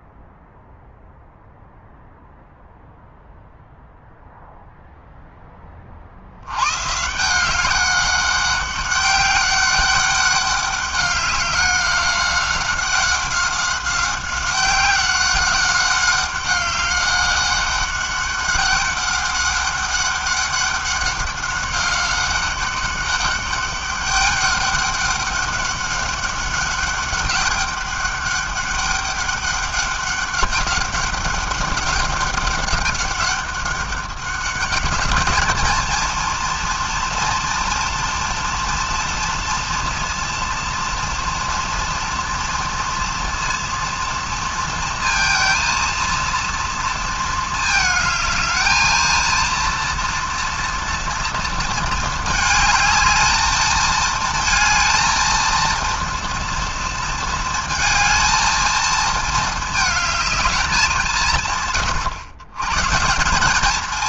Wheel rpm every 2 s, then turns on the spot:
0, 0, 0, 120, 200, 200, 190, 190, 190, 200, 200, 200, 200, 200, 200, 200, 200, 200, 230, 230, 230, 230, 230, 230, 220, 230, 220, 230, 230, 220, 200, 140.
none